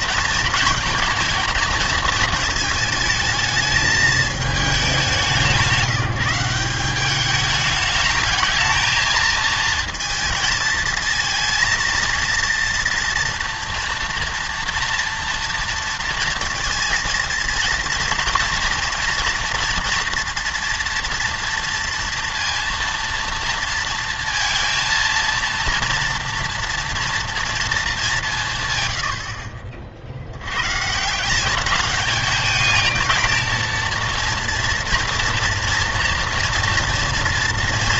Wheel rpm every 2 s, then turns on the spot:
230, 220, 210, 190, 220, 220, 230, 230, 230, 230, 230, 230, 230, 230, 130, 120, 220, 230, 240.
none